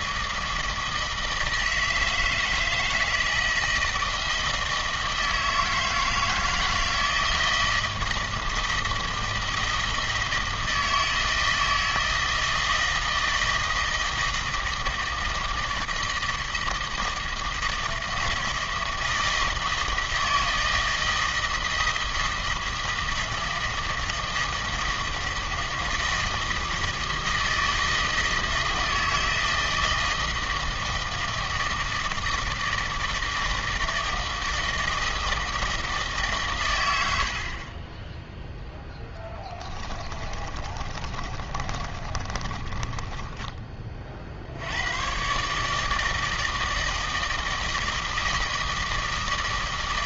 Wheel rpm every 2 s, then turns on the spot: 160, 160, 160, 160, 160, 160, 160, 160, 160, 160, 160, 160, 160, 160, 160, 160, 160, 160, 80, 0, 30, 20, 110, 160, 160.
40-44